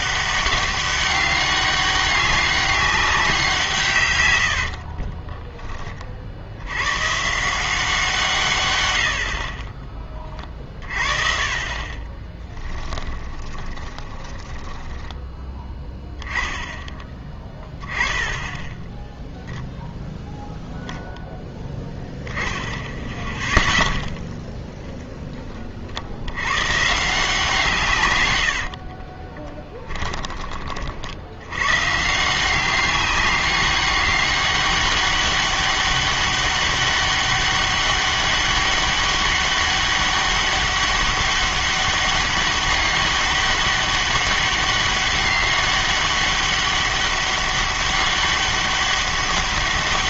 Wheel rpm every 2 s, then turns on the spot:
200, 200, 60, 90, 130, 30, 20, 10, 10, 0, 0, 10, 10, 120, 70, 40, 190, 200, 200, 200, 200, 200, 200, 200, 200.
4-6 12-16 28-30